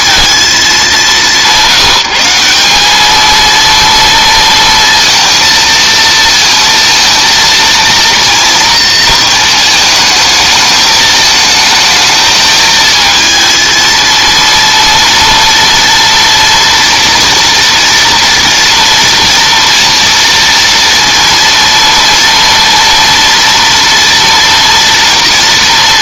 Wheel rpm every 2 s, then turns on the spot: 200, 200, 230, 230, 230, 220, 220, 230, 230, 230, 230, 230, 240.
none